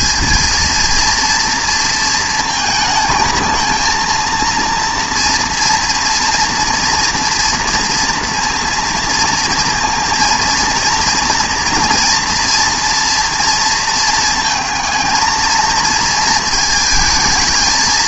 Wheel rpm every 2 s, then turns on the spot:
230, 230, 230, 230, 230, 230, 230, 220, 220.
none